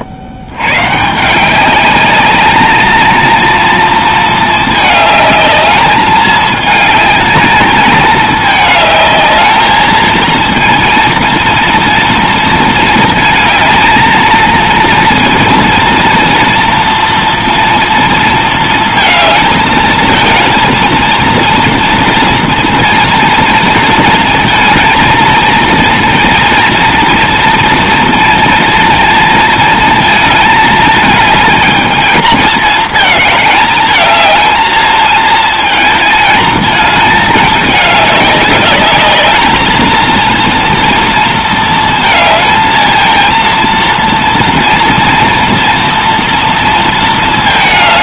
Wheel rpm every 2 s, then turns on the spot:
120, 210, 220, 220, 210, 230, 230, 230, 230, 230, 230, 230, 220, 230, 230, 220, 220, 220, 220, 200, 230, 220, 230, 230.
none